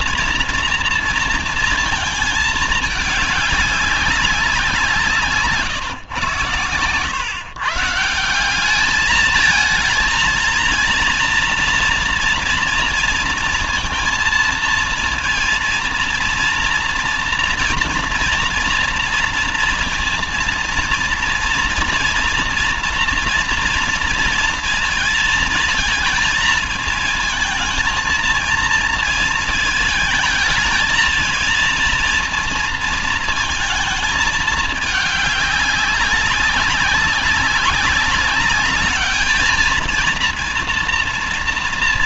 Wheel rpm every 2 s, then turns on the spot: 230, 220, 180, 110, 190, 230, 230, 230, 230, 240, 230, 230, 230, 220, 230, 220, 230, 210, 190, 200, 230.
6-8